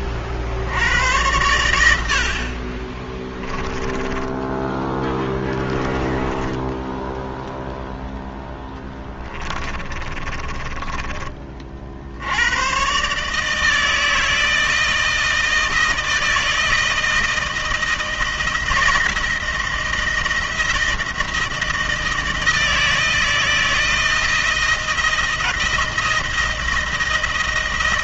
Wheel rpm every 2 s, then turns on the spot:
60, 50, 10, 10, 10, 30, 100, 160, 160, 160, 170, 160, 160, 160.
6-10